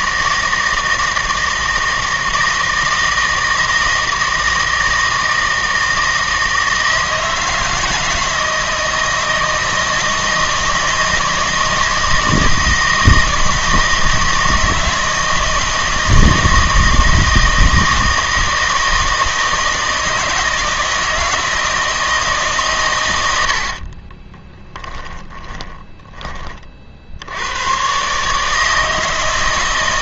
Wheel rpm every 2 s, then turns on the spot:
160, 160, 160, 160, 160, 160, 160, 160, 160, 160, 160, 140, 10, 40, 150.
24-26